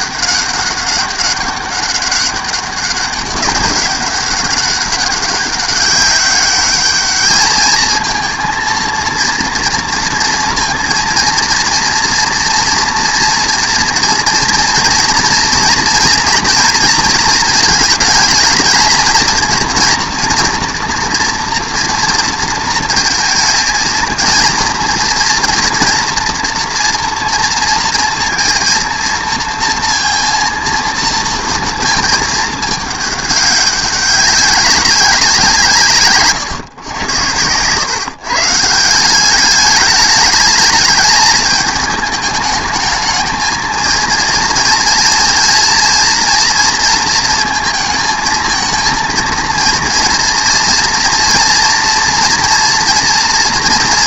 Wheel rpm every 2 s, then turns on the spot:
200, 200, 200, 200, 230, 230, 230, 230, 230, 220, 240, 230, 230, 240, 230, 230, 220, 200, 120, 160, 220, 210, 230, 230, 220, 230, 240.
none